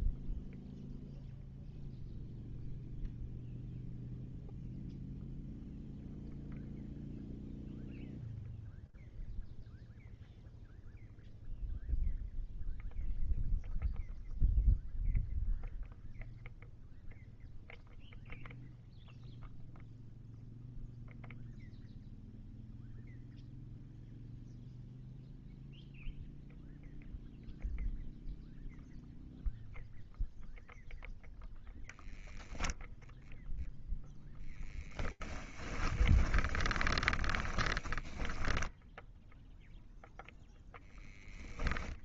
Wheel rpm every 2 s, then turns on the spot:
0, 0, 0, 0, 0, 0, 0, 0, 0, 0, 0, 0, 0, 0, 0, 0, 10, 0, 10, 20, 0.
32-34 36-40